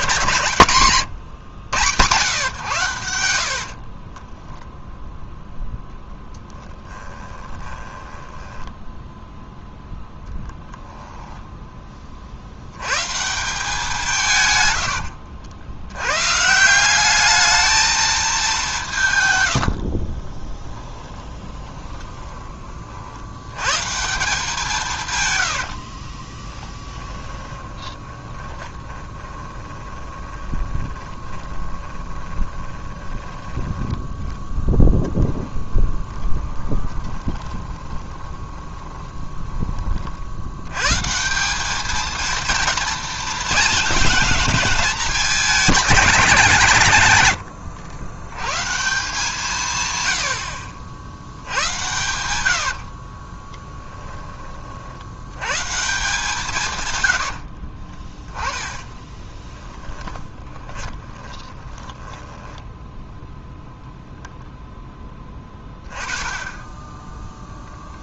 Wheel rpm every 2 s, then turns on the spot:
130, 120, 0, 10, 10, 10, 80, 110, 170, 190, 20, 30, 170, 20, 20, 20, 20, 10, 20, 20, 90, 230, 210, 160, 140, 70, 70, 30, 150, 20, 20, 10, 10, 20.
6-12 14-16 20-22 26-34 36-40 52-54 58-62 66-68